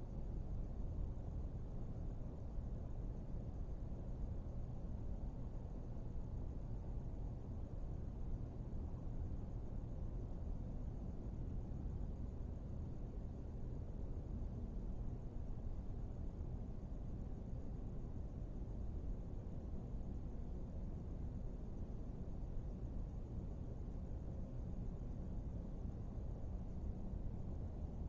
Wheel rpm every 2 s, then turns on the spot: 0, 0, 0, 0, 0, 0, 0, 0, 0, 0, 0, 0, 0, 0.
none